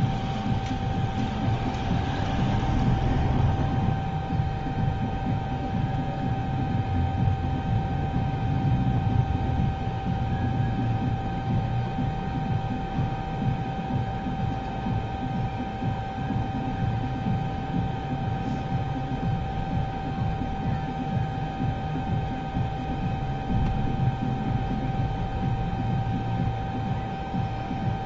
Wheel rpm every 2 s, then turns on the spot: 0, 0, 0, 0, 0, 0, 0, 0, 0, 0, 0, 0, 0, 0.
none